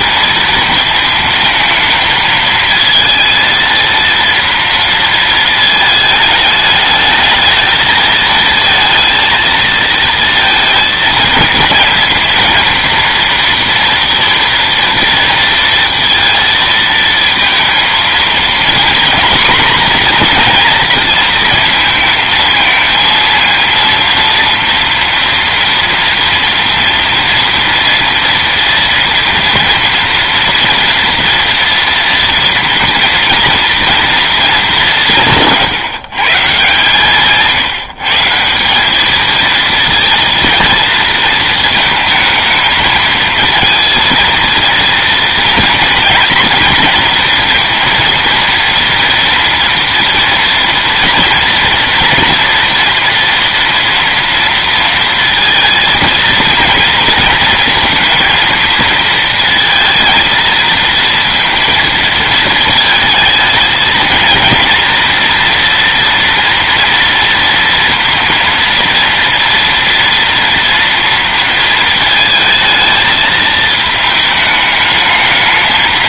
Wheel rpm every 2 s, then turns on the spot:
230, 220, 230, 210, 220, 230, 230, 230, 230, 230, 240, 220, 230, 230, 230, 230, 240, 200, 150, 180, 230, 220, 230, 230, 230, 230, 240, 230, 230, 230, 230, 220, 230, 230, 230, 230, 220, 210.
none